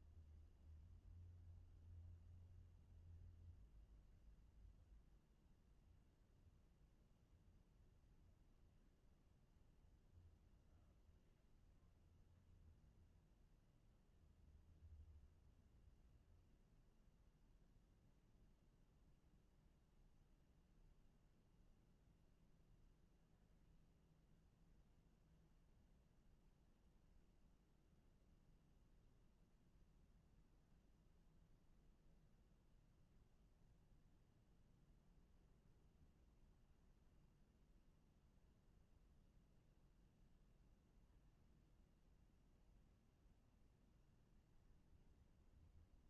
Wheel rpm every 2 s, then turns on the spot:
0, 0, 0, 0, 0, 0, 0, 0, 0, 0, 0, 0, 0, 0, 0, 0, 0, 0, 0, 0, 0, 0, 0.
none